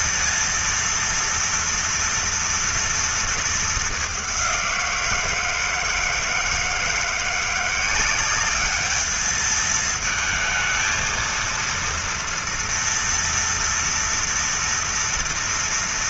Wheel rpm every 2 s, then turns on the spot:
230, 230, 170, 160, 210, 230, 230, 230.
none